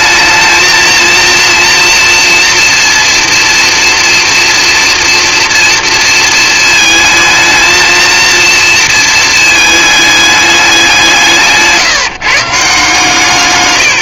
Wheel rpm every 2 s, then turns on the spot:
220, 230, 230, 220, 230, 190, 150.
none